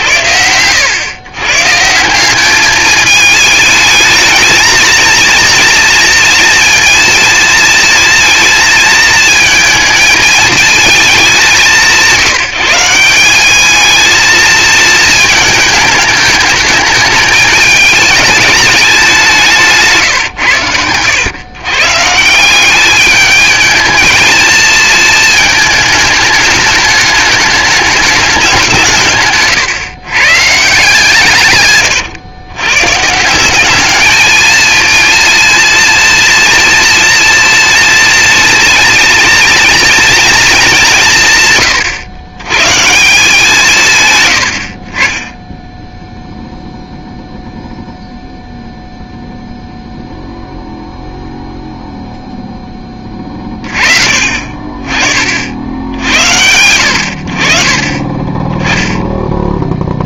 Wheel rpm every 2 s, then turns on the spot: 90, 200, 230, 230, 220, 220, 170, 220, 210, 210, 110, 190, 230, 220, 190, 150, 120, 220, 230, 230, 210, 130, 80, 0, 0, 0, 10, 40, 90, 10.
none